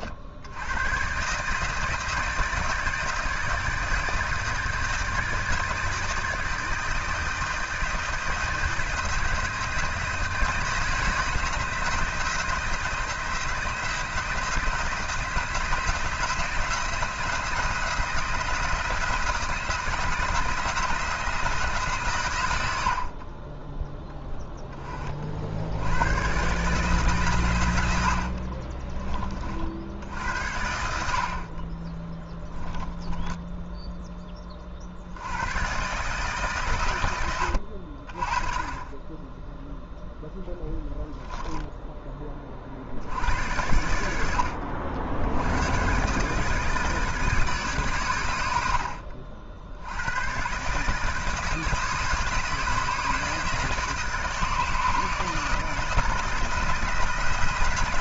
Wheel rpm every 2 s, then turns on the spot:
100, 160, 160, 160, 170, 160, 170, 170, 170, 170, 170, 80, 20, 150, 30, 80, 10, 50, 130, 30, 0, 50, 70, 160, 70, 140, 160, 150, 170.
28-30